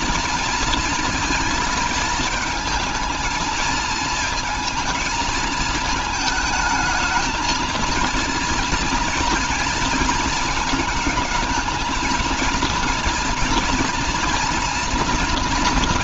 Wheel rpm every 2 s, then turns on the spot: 220, 230, 220, 220, 240, 220, 220, 230.
none